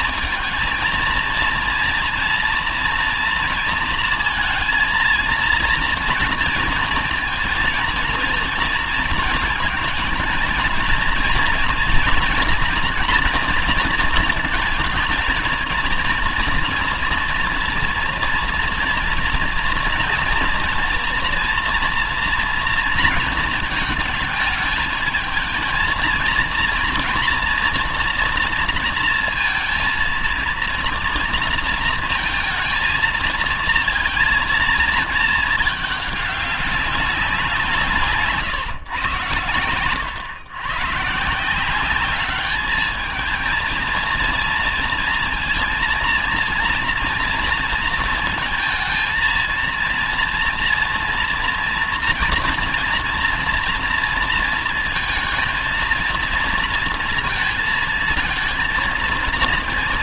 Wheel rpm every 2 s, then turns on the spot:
230, 230, 230, 230, 230, 220, 240, 220, 230, 240, 240, 230, 220, 230, 230, 230, 220, 230, 200, 140, 130, 210, 230, 230, 220, 230, 240, 230, 230, 230.
none